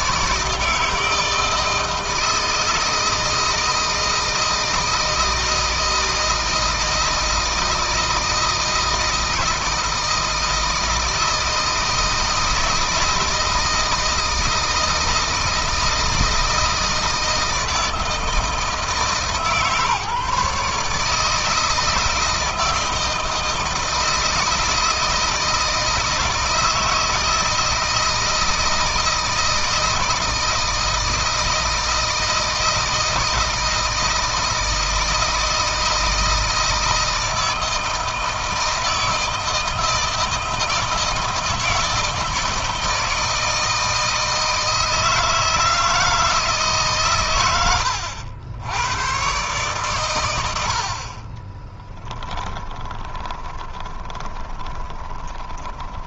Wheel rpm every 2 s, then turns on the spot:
160, 160, 160, 160, 160, 160, 160, 160, 160, 160, 150, 160, 160, 160, 160, 160, 160, 160, 160, 160, 160, 160, 160, 150, 100, 50, 20, 20.
52-56